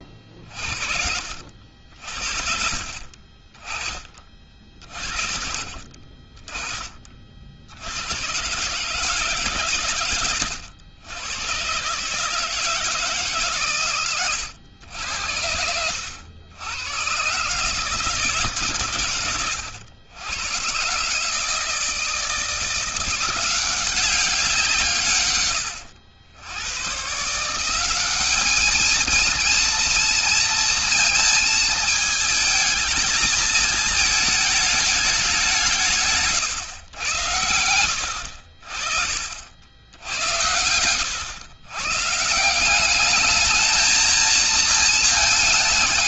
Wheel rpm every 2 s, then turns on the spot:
40, 50, 40, 30, 120, 130, 160, 90, 100, 140, 110, 160, 180, 110, 210, 230, 220, 220, 130, 80, 90, 170, 230.
none